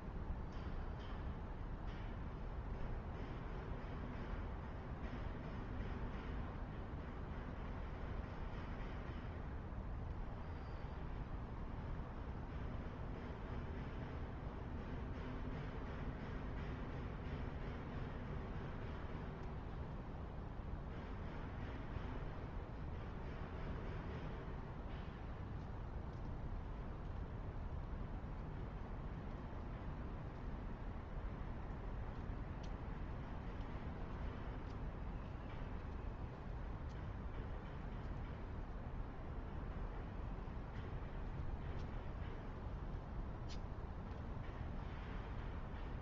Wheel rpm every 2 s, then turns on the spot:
0, 0, 0, 0, 0, 0, 0, 0, 0, 0, 0, 0, 0, 0, 0, 0, 0, 0, 0, 0, 0, 0, 0.
none